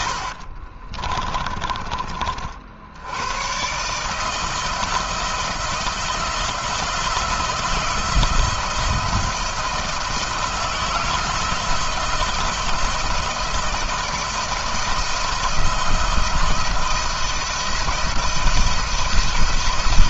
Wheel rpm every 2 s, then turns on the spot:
30, 70, 160, 160, 170, 170, 170, 170, 170, 170.
0-2